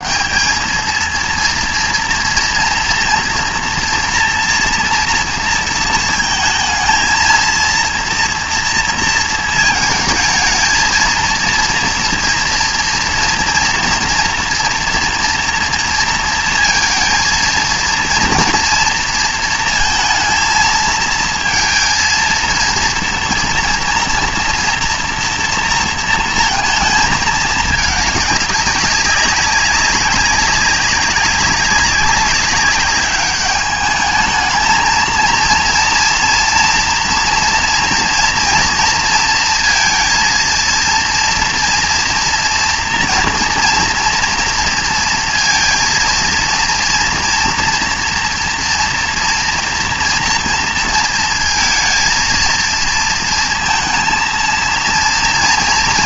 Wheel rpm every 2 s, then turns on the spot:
210, 230, 230, 220, 230, 220, 230, 240, 230, 230, 220, 230, 240, 230, 200, 200, 200, 220, 230, 240, 230, 230, 230, 230, 230, 230, 230, 230.
none